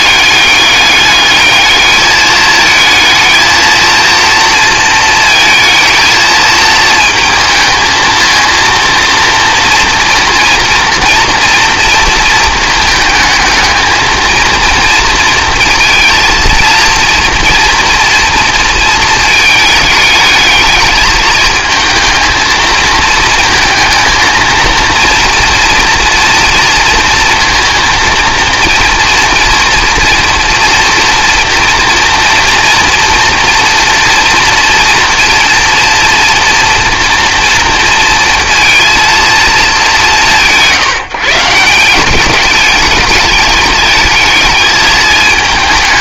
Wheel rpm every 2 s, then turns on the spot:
210, 220, 230, 220, 230, 230, 220, 230, 230, 230, 220, 220, 230, 230, 230, 230, 240, 230, 230, 230, 170, 210, 220.
none